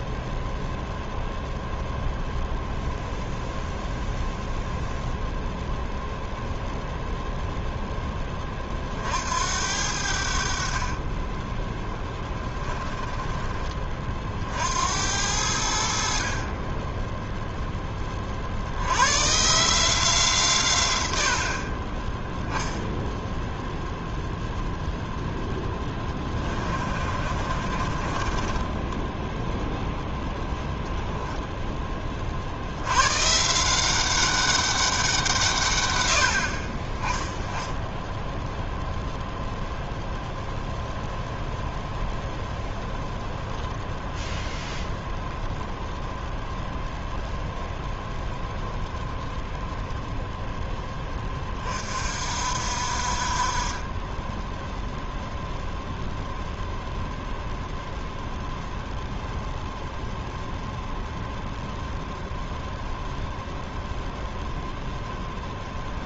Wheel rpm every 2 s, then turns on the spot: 0, 0, 0, 0, 40, 50, 10, 70, 20, 90, 110, 0, 0, 30, 20, 0, 90, 190, 30, 0, 0, 0, 10, 0, 10, 10, 50, 0, 0, 0, 0, 0, 0.
12-14 26-30 48-50